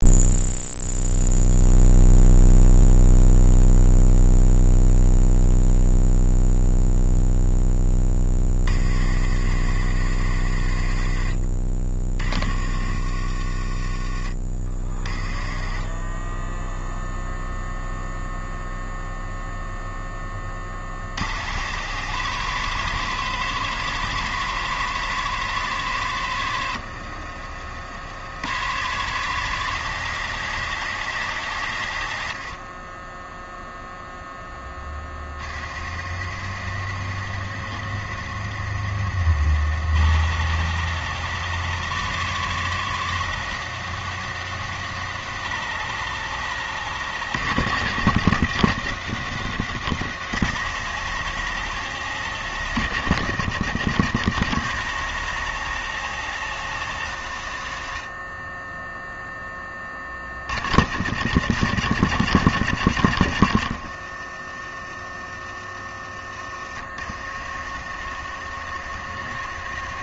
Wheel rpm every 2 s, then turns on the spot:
0, 0, 0, 0, 50, 40, 40, 20, 0, 0, 80, 140, 140, 60, 120, 120, 10, 30, 70, 90, 140, 140, 140, 140, 120, 130, 130, 140, 110, 0, 100, 90, 40, 50, 70.
26-28